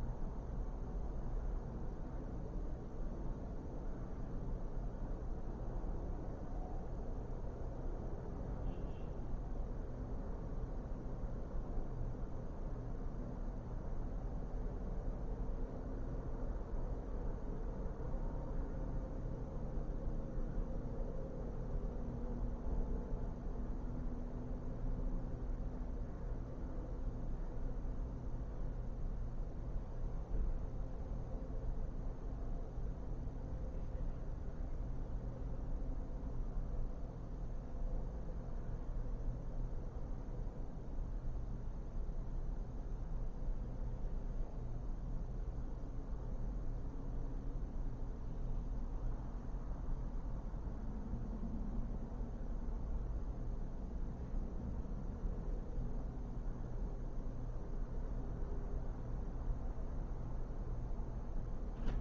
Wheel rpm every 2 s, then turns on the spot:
0, 0, 0, 0, 0, 0, 0, 0, 0, 0, 0, 0, 0, 0, 0, 0, 0, 0, 0, 0, 0, 0, 0, 0, 0, 0, 0, 0, 0, 0, 0.
none